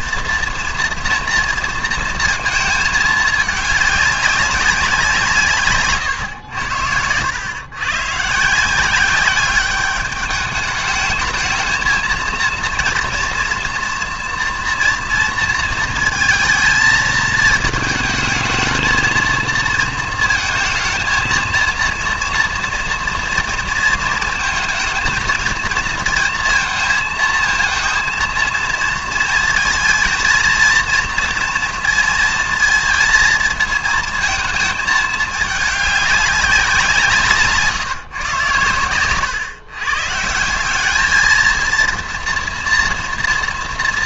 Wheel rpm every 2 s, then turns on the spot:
240, 230, 200, 90, 170, 210, 230, 240, 220, 220, 230, 230, 220, 230, 230, 230, 230, 220, 190, 130, 190, 230.
none